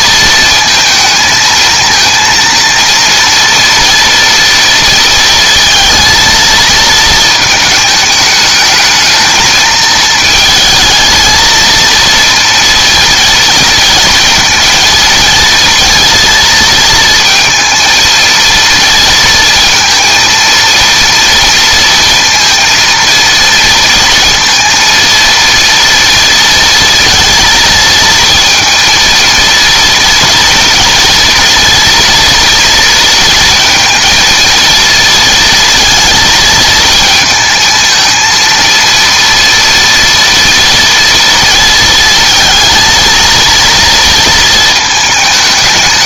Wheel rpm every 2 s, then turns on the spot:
230, 230, 230, 230, 210, 220, 230, 230, 230, 230, 230, 230, 230, 230, 230, 230, 230, 230, 220, 230, 230, 230, 220.
none